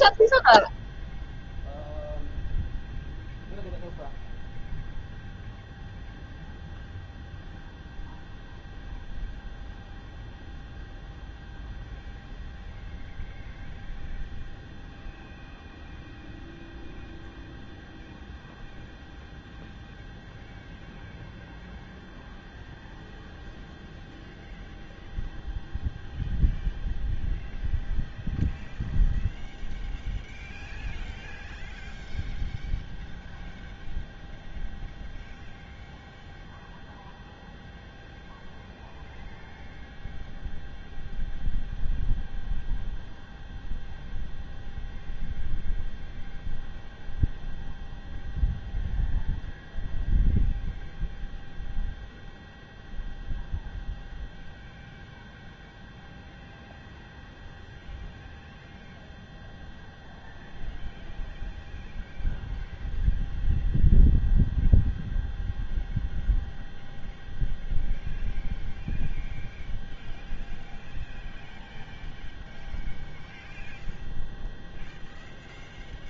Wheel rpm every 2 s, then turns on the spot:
0, 0, 0, 0, 0, 0, 0, 0, 0, 0, 0, 0, 0, 0, 0, 0, 0, 0, 0, 0, 0, 0, 0, 0, 0, 0, 0, 0, 0, 0, 0, 0, 0, 0, 0, 0, 0, 0.
none